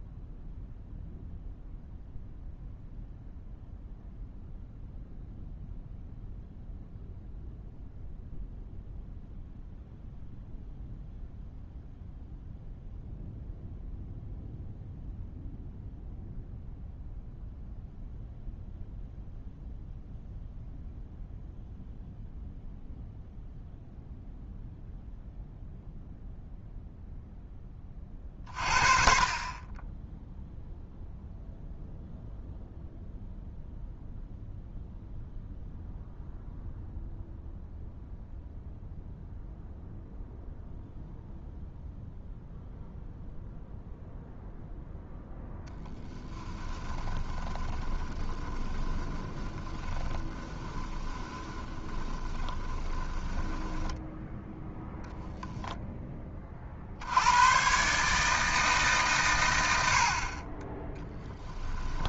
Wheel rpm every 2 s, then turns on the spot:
0, 0, 0, 0, 0, 0, 0, 0, 0, 0, 0, 0, 0, 0, 40, 0, 0, 0, 0, 0, 0, 0, 0, 20, 20, 20, 10, 10, 60, 150, 20.
46-54